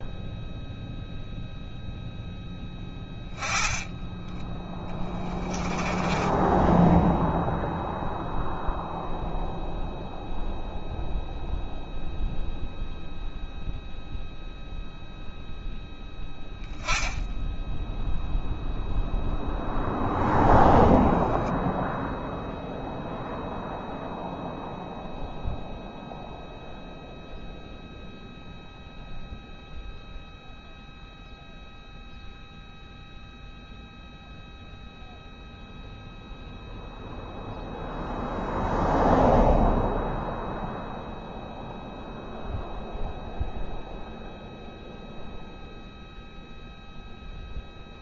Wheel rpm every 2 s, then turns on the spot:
0, 20, 10, 0, 0, 0, 0, 0, 10, 0, 10, 0, 0, 0, 0, 0, 0, 0, 0, 0, 0, 0, 0, 0.
4-6 20-22